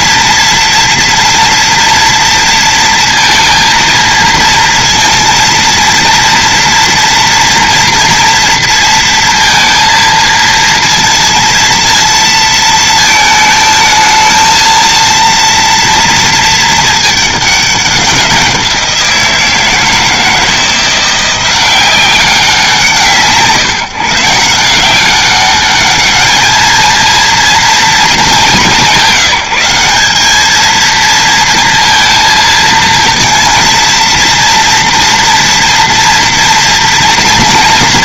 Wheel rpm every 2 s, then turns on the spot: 230, 230, 230, 230, 230, 230, 230, 230, 220, 180, 170, 170, 170, 220, 200, 220, 230, 230, 230.
none